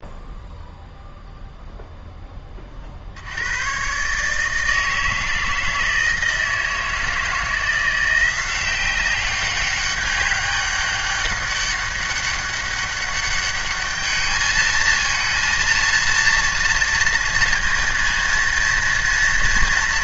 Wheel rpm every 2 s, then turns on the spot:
0, 40, 160, 160, 190, 200, 200, 220, 230, 230.
none